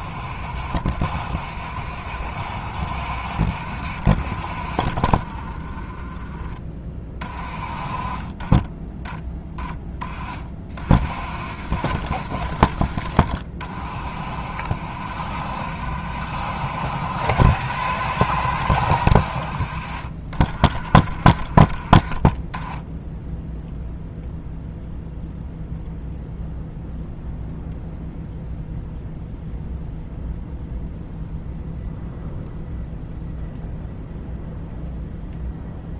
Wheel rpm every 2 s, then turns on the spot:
40, 60, 50, 30, 10, 40, 40, 50, 90, 80, 50, 10, 0, 0, 0, 0, 0, 0.
none